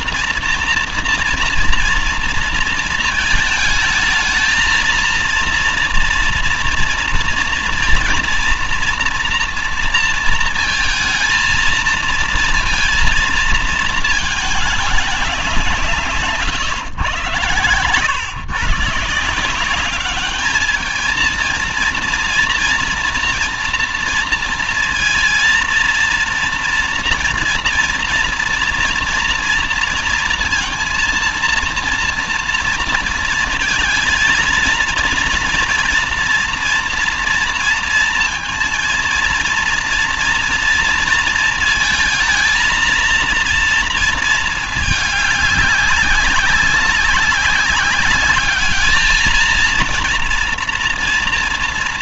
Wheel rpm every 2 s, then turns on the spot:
230, 230, 230, 230, 230, 230, 230, 210, 120, 140, 210, 230, 230, 230, 240, 230, 230, 230, 230, 230, 230, 230, 220, 200, 210, 240.
none